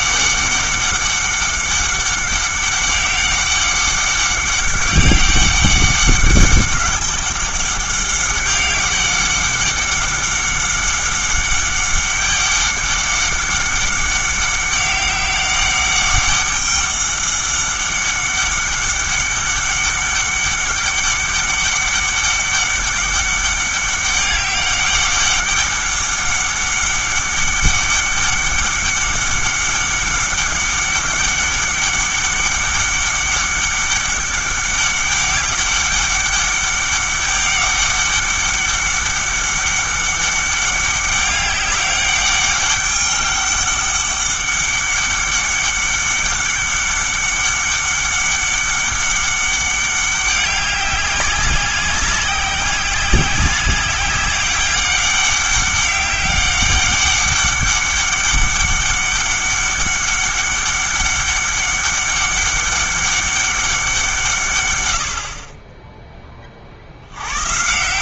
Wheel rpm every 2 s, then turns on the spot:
200, 190, 200, 200, 190, 200, 200, 190, 200, 200, 200, 200, 200, 200, 200, 200, 200, 200, 200, 200, 200, 200, 200, 200, 200, 190, 190, 200, 200, 200, 200, 200, 110, 50.
none